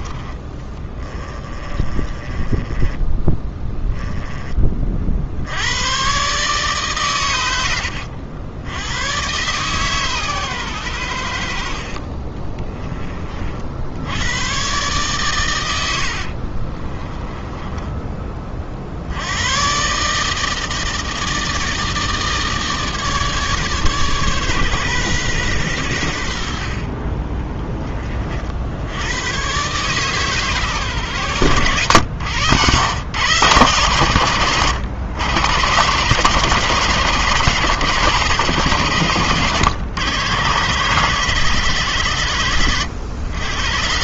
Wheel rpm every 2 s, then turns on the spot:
20, 20, 40, 140, 100, 100, 20, 130, 30, 60, 160, 150, 130, 40, 80, 130, 120, 110, 150, 130, 140, 110.
0-4 16-18